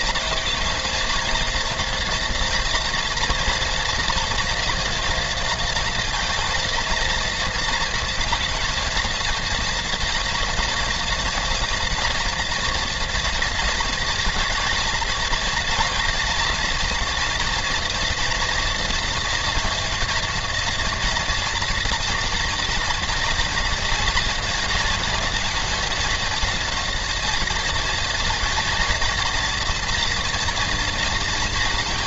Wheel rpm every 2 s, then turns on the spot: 220, 230, 230, 230, 230, 240, 230, 220, 230, 230, 230, 240, 230, 230, 230, 230.
none